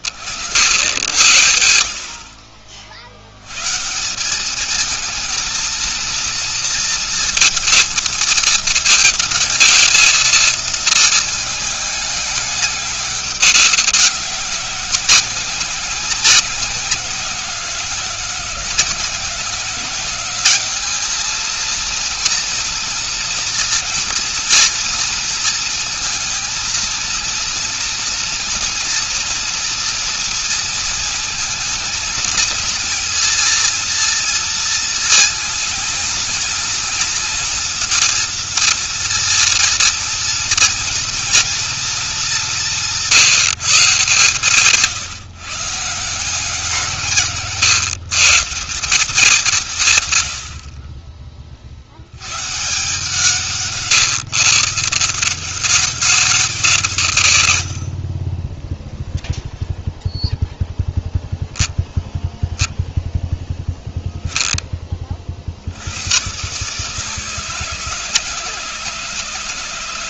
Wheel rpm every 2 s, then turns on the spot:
90, 60, 190, 230, 220, 220, 200, 190, 190, 180, 200, 240, 230, 230, 230, 230, 230, 230, 230, 230, 230, 200, 150, 170, 160, 100, 120, 140, 180, 30, 0, 0, 10, 110, 160.
none